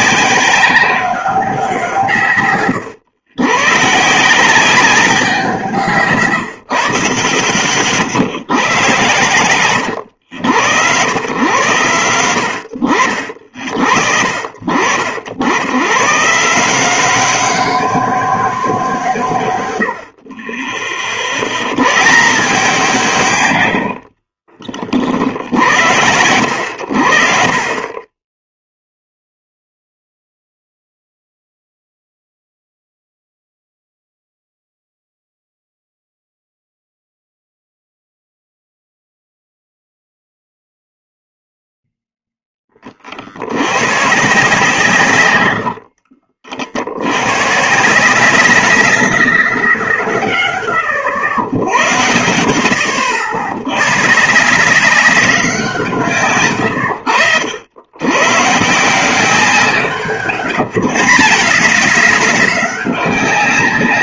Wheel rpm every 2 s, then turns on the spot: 200, 130, 180, 110, 100, 110, 70, 50, 160, 190, 30, 180, 50, 80, 10, 0, 0, 0, 0, 0, 0, 20, 160, 70, 190, 120, 90, 170, 110, 140, 140, 200.
24-26 56-58